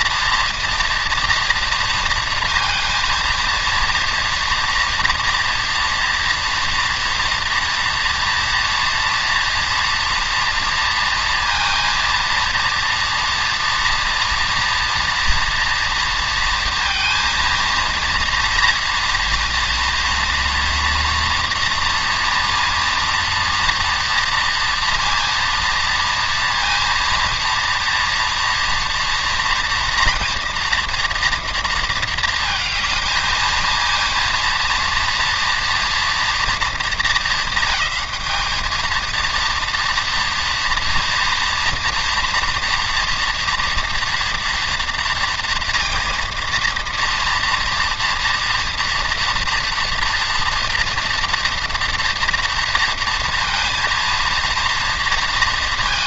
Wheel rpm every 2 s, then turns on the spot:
240, 230, 230, 230, 230, 230, 230, 230, 230, 230, 230, 230, 230, 230, 230, 230, 220, 230, 220, 220, 230, 230, 240, 230, 230, 240, 230, 230.
none